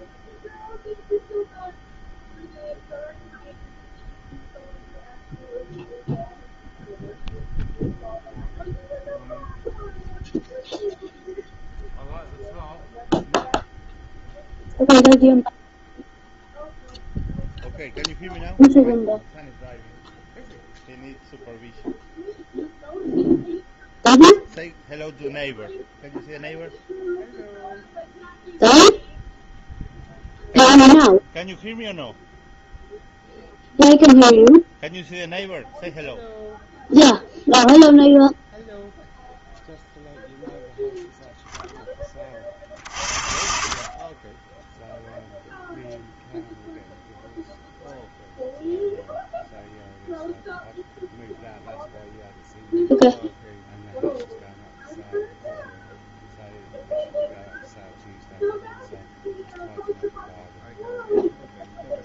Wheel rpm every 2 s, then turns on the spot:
0, 0, 0, 0, 0, 0, 0, 0, 0, 0, 0, 0, 0, 0, 0, 0, 0, 0, 0, 0, 0, 30, 20, 0, 0, 0, 0, 0, 0, 0, 0.
42-46